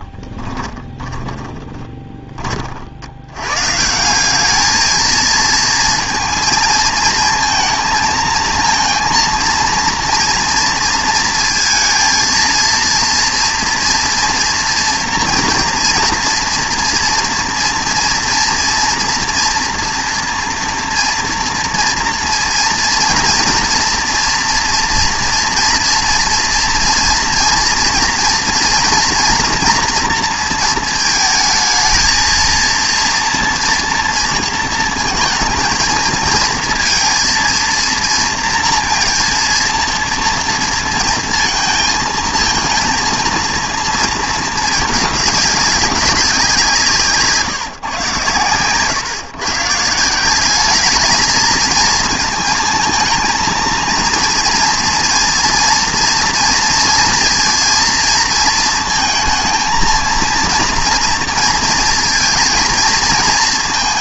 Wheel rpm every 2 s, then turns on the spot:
20, 40, 210, 230, 230, 240, 230, 230, 230, 230, 240, 230, 230, 230, 230, 230, 230, 230, 230, 230, 230, 230, 220, 180, 120, 200, 220, 230, 230, 230, 230, 230.
0-2